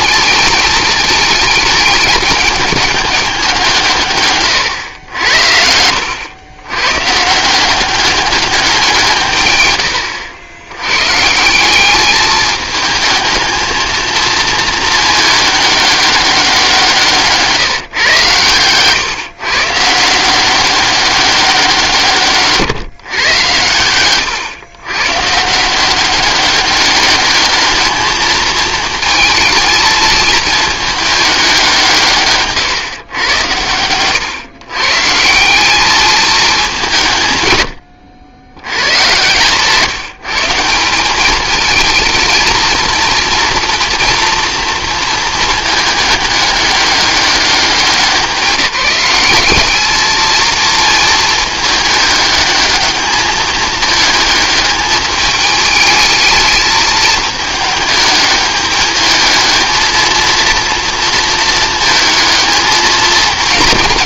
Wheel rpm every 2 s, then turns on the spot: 210, 210, 120, 100, 190, 100, 220, 230, 180, 130, 190, 150, 120, 200, 220, 220, 130, 130, 200, 100, 170, 230, 230, 200, 190, 220, 220, 210, 220, 210, 230, 220.
4-6